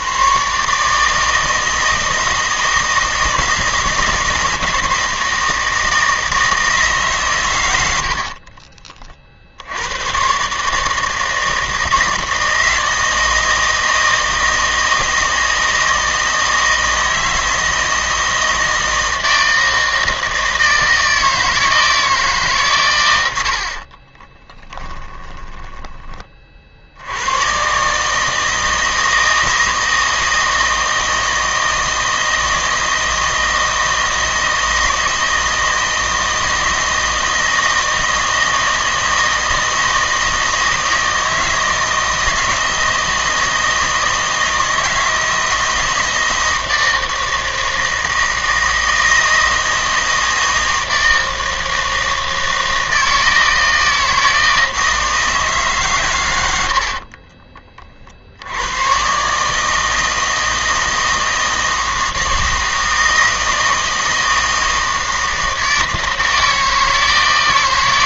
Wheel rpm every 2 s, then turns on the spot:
140, 160, 160, 160, 40, 150, 160, 160, 160, 160, 160, 130, 10, 50, 160, 160, 160, 160, 160, 160, 160, 160, 160, 160, 160, 160, 160, 160, 70, 100, 160, 160, 160, 160.
8-10 24-26 56-58